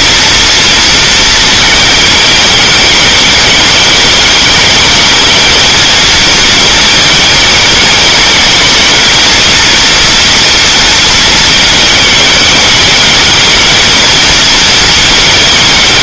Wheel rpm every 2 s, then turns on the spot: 230, 210, 210, 220, 220, 230, 220, 230.
none